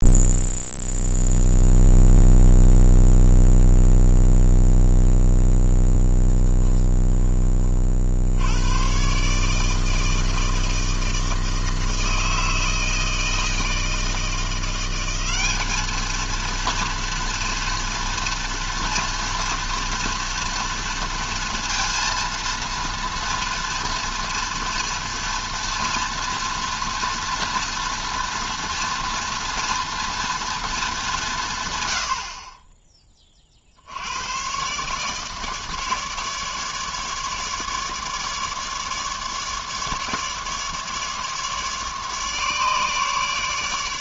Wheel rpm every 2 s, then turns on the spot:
0, 0, 0, 10, 90, 160, 160, 170, 230, 230, 230, 230, 230, 230, 240, 220, 30, 130, 150, 150, 150, 150.
none